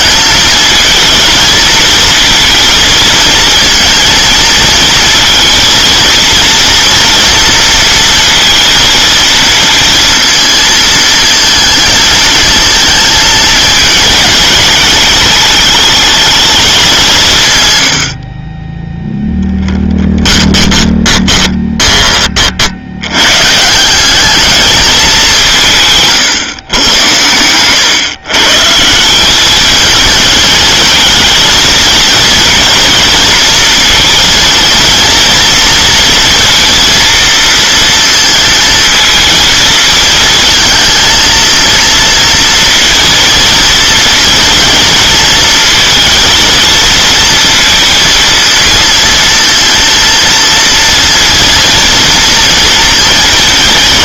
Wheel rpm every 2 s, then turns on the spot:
220, 220, 230, 230, 230, 230, 220, 220, 210, 20, 10, 60, 210, 120, 150, 220, 230, 230, 230, 230, 230, 230, 230, 230, 230, 230, 230.
20-22